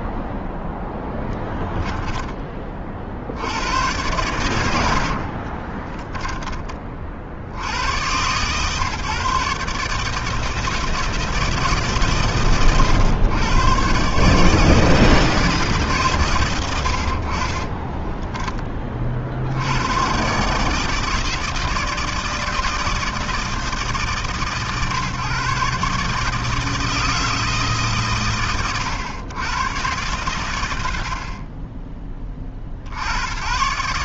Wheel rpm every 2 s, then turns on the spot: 10, 50, 40, 50, 140, 150, 110, 160, 50, 40, 160, 160, 140, 160, 110, 60, 100.
4-6